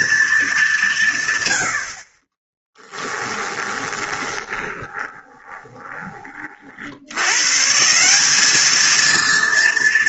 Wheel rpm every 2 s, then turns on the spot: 140, 10, 20, 80, 230.
2-6